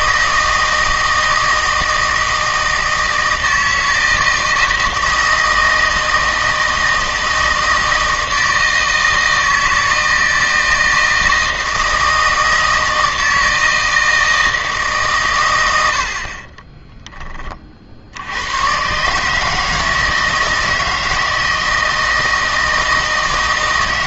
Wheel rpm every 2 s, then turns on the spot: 160, 160, 160, 160, 160, 160, 160, 160, 20, 100, 160, 160.
16-18